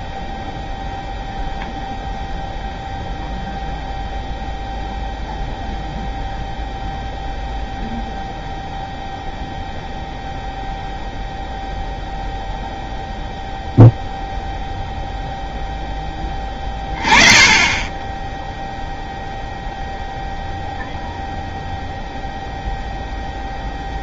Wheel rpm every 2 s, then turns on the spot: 0, 0, 0, 0, 0, 0, 0, 0, 20, 0, 0, 0.
none